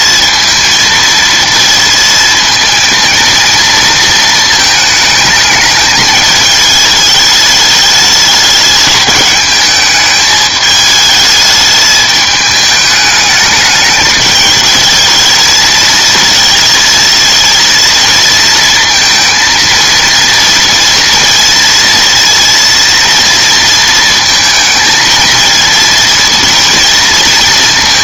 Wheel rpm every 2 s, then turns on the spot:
230, 230, 220, 220, 210, 210, 210, 220, 230, 230, 230, 230, 220, 230.
none